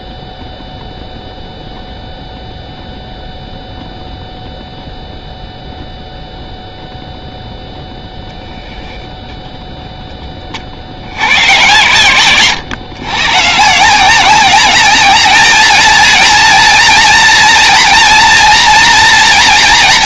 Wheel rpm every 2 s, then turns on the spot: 0, 0, 0, 0, 0, 30, 120, 180, 230, 230.
none